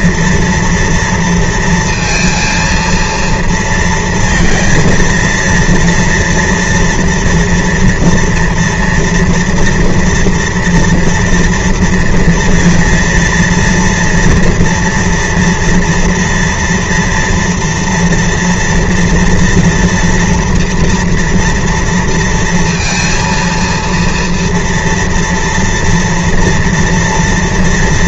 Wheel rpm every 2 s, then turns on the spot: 230, 230, 230, 230, 230, 230, 230, 230, 240, 230, 230, 230, 230, 230.
none